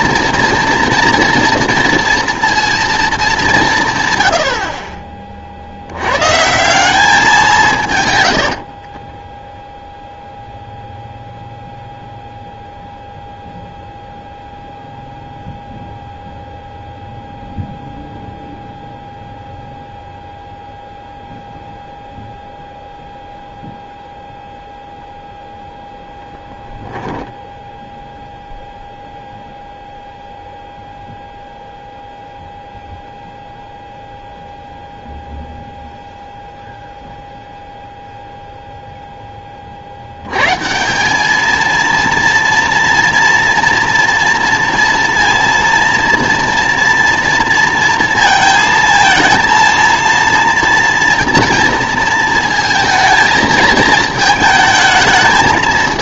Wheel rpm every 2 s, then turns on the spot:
230, 230, 60, 170, 70, 0, 0, 0, 0, 0, 0, 0, 0, 0, 0, 0, 0, 0, 0, 0, 150, 230, 230, 230, 230, 240, 220, 220.
8-10